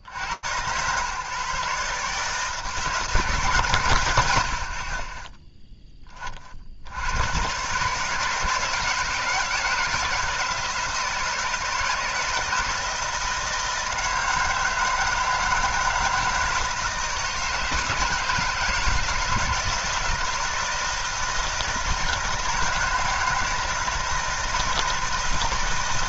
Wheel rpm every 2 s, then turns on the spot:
100, 160, 80, 40, 160, 160, 160, 160, 160, 160, 160, 160, 160.
none